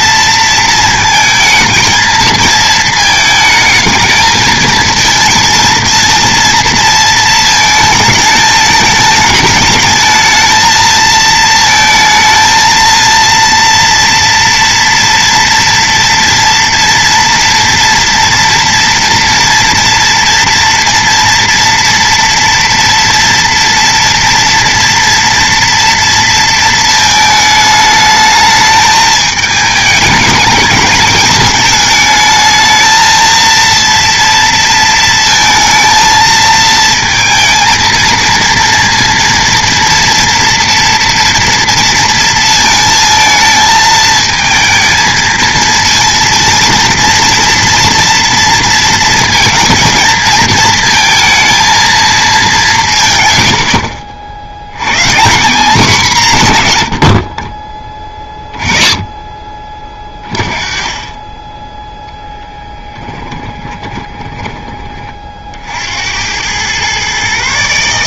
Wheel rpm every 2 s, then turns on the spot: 230, 220, 220, 230, 220, 220, 220, 240, 230, 230, 230, 230, 230, 230, 220, 210, 220, 230, 230, 230, 240, 230, 220, 230, 230, 230, 180, 90, 140, 20, 20, 10, 20, 110.
62-64